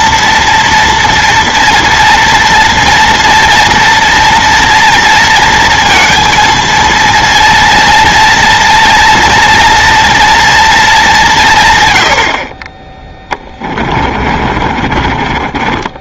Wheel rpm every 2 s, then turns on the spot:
230, 230, 230, 230, 230, 210, 20, 40.
14-16